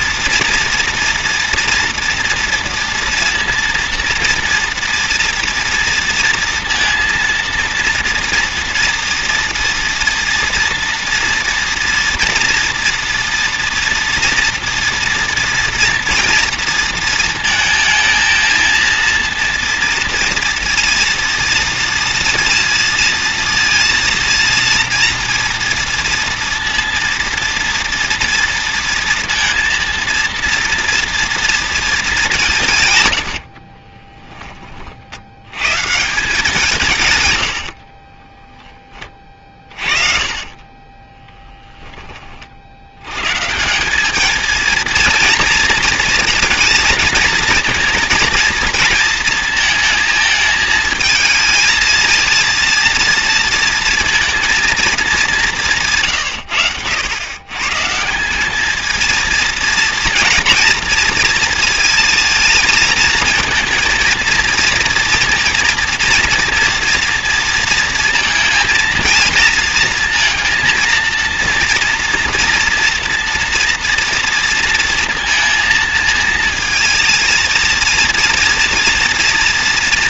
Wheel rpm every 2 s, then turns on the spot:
230, 240, 230, 230, 240, 230, 230, 230, 230, 230, 230, 230, 230, 230, 230, 230, 140, 30, 170, 10, 30, 70, 230, 230, 230, 220, 230, 230, 110, 210, 240, 230, 230, 230, 230, 230, 240, 230, 220, 230.
40-42